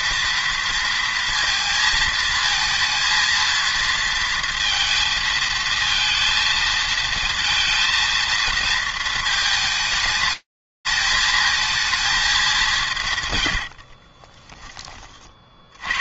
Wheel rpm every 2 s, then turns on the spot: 230, 230, 230, 230, 230, 220, 120, 50.
none